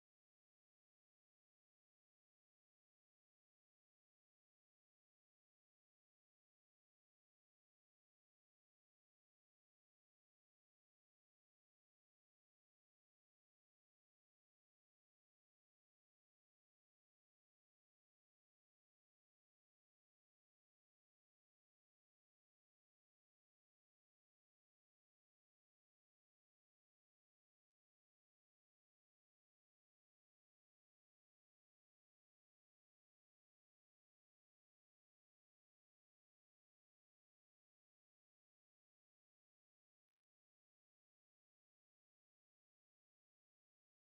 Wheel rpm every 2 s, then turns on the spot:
0, 0, 0, 0, 0, 0, 0, 0, 0, 0, 0, 0, 0, 0, 0, 0, 0, 0, 0, 0, 0, 0.
none